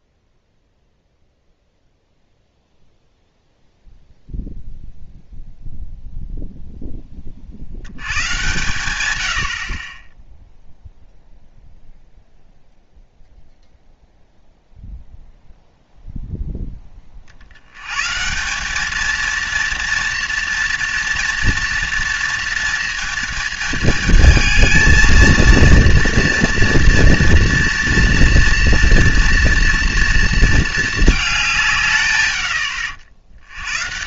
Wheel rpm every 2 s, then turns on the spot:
0, 0, 0, 10, 120, 0, 0, 0, 10, 200, 230, 230, 220, 230, 230, 220, 80.
none